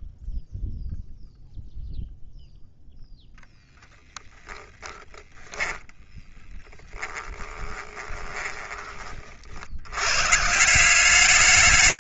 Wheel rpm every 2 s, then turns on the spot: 0, 0, 0, 20, 80, 210.
6-8